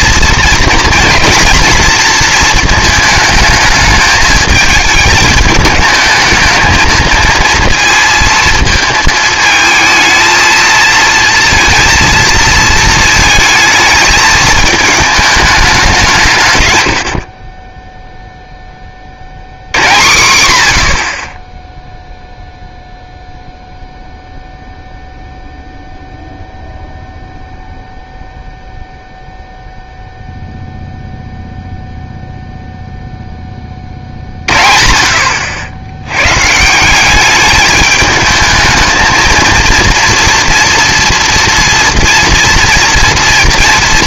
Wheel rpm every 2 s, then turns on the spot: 230, 220, 220, 220, 230, 220, 230, 220, 120, 20, 90, 0, 0, 0, 0, 0, 0, 40, 160, 220, 230, 230.
none